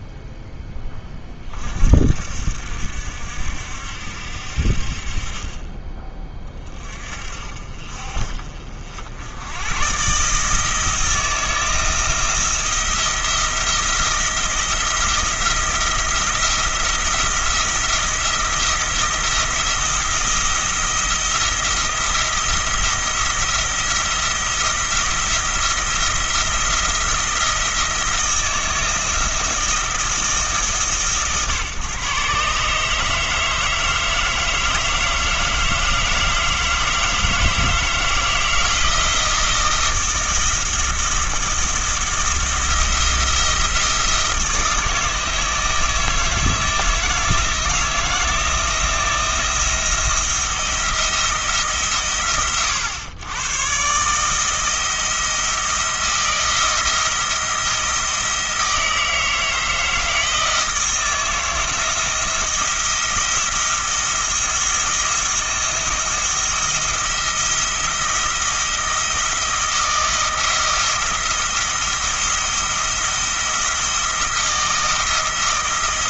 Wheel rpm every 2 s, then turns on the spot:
10, 70, 50, 40, 60, 160, 170, 170, 170, 170, 170, 170, 170, 170, 160, 150, 140, 160, 160, 170, 170, 170, 160, 160, 170, 170, 110, 160, 170, 160, 160, 170, 170, 170, 170, 170, 170, 170.
none